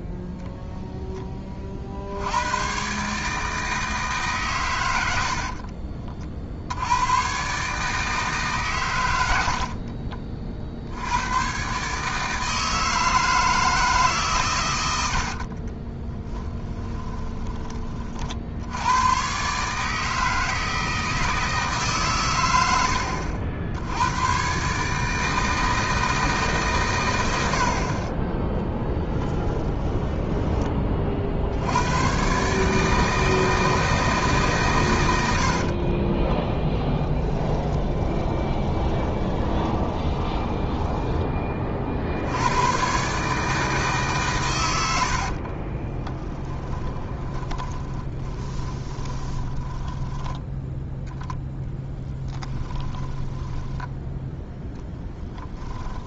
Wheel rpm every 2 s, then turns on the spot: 0, 120, 100, 90, 120, 70, 160, 100, 20, 100, 160, 90, 150, 120, 10, 30, 150, 120, 30, 20, 10, 120, 100, 10, 20, 0, 20, 10.
14-18 36-42 46-50 52-54